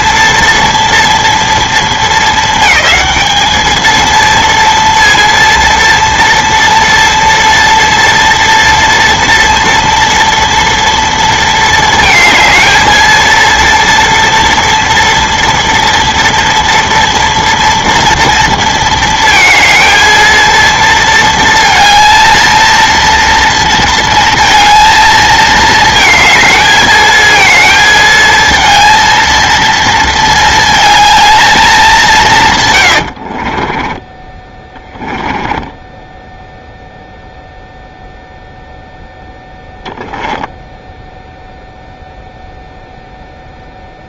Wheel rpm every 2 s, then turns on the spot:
230, 220, 230, 230, 230, 230, 220, 230, 230, 230, 230, 230, 230, 220, 230, 220, 120, 10, 0, 0, 0, 0.
32-36